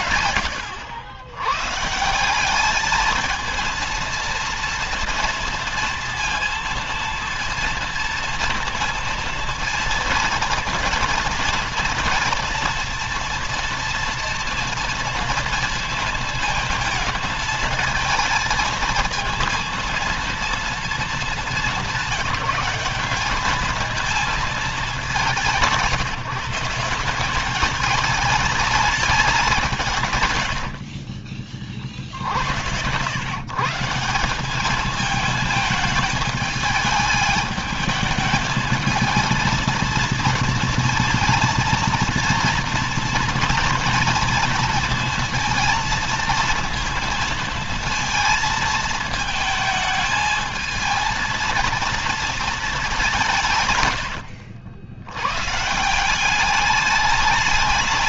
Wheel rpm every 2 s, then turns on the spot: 110, 210, 230, 230, 230, 230, 230, 230, 230, 230, 230, 190, 210, 170, 220, 70, 90, 200, 210, 220, 230, 230, 230, 220, 220, 220, 200, 90, 200.
30-32